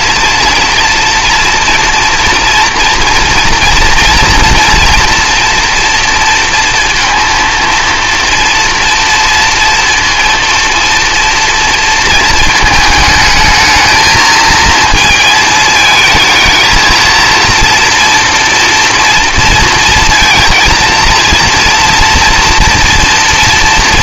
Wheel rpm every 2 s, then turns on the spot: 230, 240, 240, 230, 230, 230, 220, 220, 220, 230, 230, 230.
none